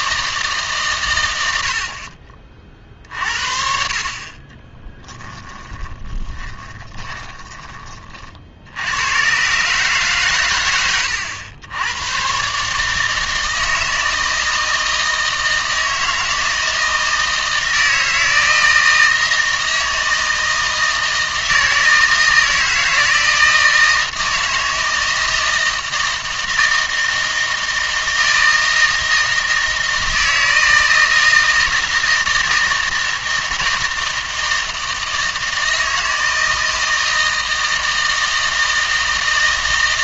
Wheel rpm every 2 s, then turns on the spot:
150, 40, 20, 30, 70, 110, 140, 160, 160, 160, 160, 160, 160, 160, 160, 160, 160, 160, 160, 160.
4-8